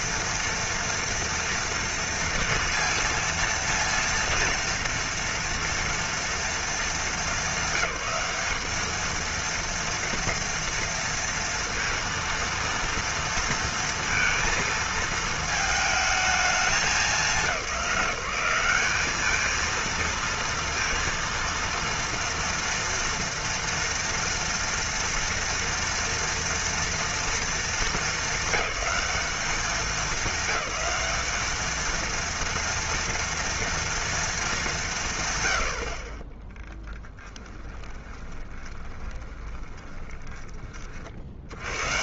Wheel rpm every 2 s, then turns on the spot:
230, 230, 230, 210, 210, 230, 230, 230, 190, 200, 230, 230, 230, 230, 200, 210, 230, 170, 20, 20, 70.
36-40